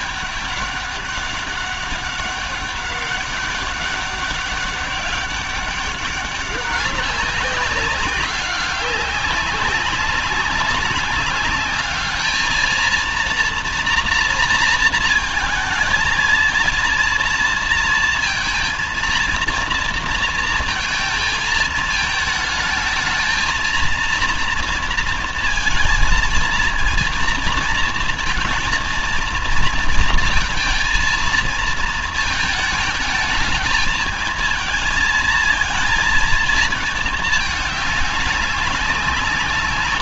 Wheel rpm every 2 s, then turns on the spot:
200, 200, 200, 190, 190, 190, 220, 230, 230, 230, 230, 220, 230, 230, 230, 230, 220, 220, 220, 190.
none